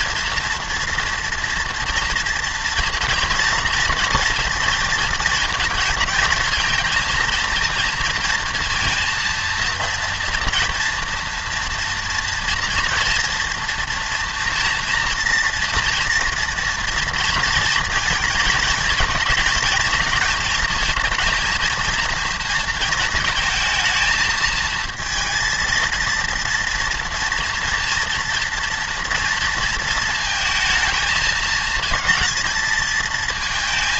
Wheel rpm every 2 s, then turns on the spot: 230, 240, 230, 220, 230, 230, 230, 230, 230, 230, 220, 230, 220, 230, 230, 220, 230.
none